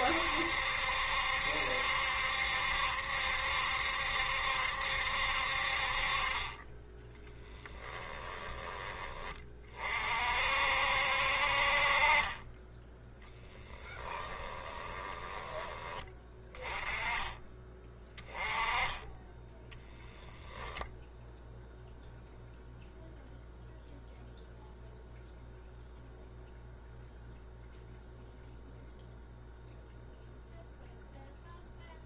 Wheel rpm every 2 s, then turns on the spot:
70, 70, 60, 10, 20, 60, 10, 20, 20, 10, 0, 0, 0, 0, 0, 0.
14-16